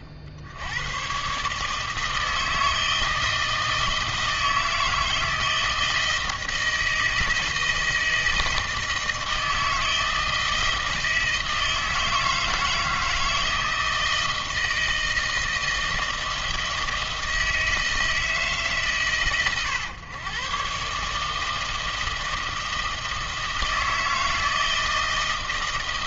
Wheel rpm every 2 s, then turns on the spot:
60, 160, 160, 160, 160, 160, 160, 160, 160, 150, 120, 160, 160.
none